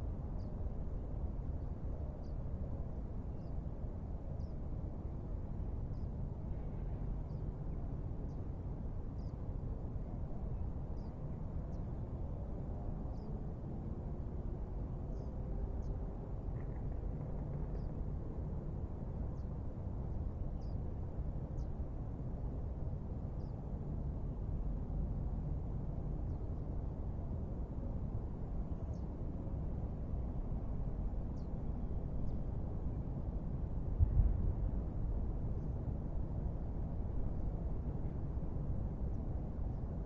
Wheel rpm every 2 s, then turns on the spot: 0, 0, 0, 0, 0, 0, 0, 0, 0, 0, 0, 0, 0, 0, 0, 0, 0, 0, 0, 0.
none